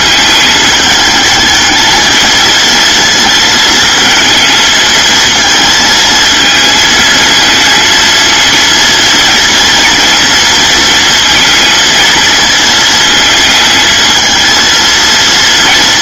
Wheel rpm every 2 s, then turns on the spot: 220, 230, 220, 220, 230, 230, 220, 230.
none